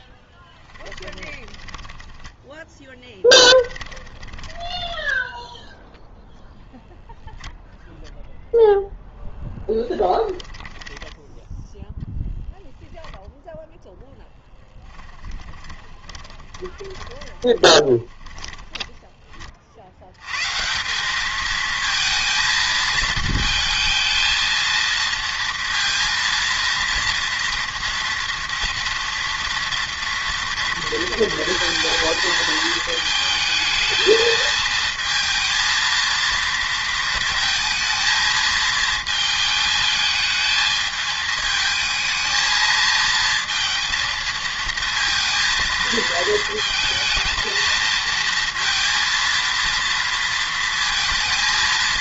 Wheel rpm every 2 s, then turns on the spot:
10, 10, 10, 0, 0, 10, 10, 10, 20, 20, 180, 220, 230, 230, 230, 230, 220, 220, 230, 230, 220, 220, 230, 230, 230, 230.
0-6 10-12 14-20